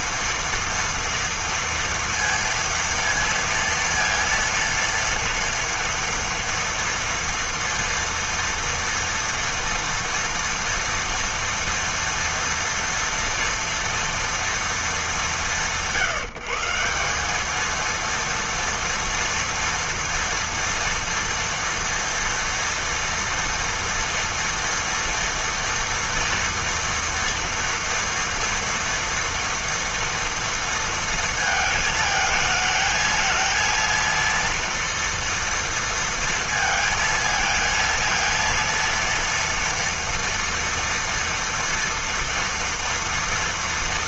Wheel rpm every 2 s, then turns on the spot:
230, 230, 230, 230, 230, 230, 230, 230, 170, 230, 230, 230, 230, 230, 230, 230, 220, 230, 230, 230, 230, 230.
none